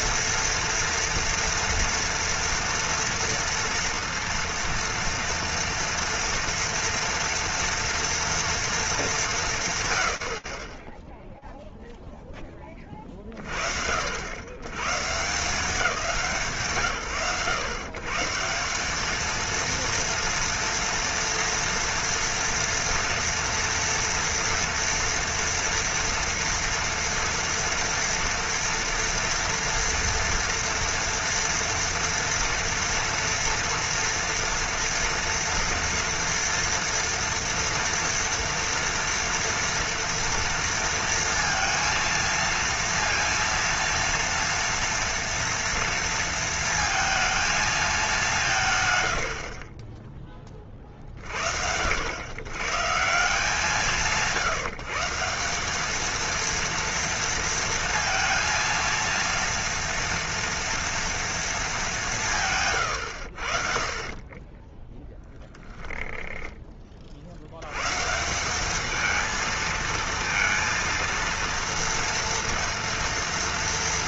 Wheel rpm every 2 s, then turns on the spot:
230, 230, 230, 230, 230, 40, 40, 140, 100, 220, 230, 230, 230, 230, 230, 230, 230, 240, 230, 230, 230, 230, 230, 230, 90, 40, 160, 170, 230, 230, 230, 90, 0, 20, 210, 230, 230.
62-64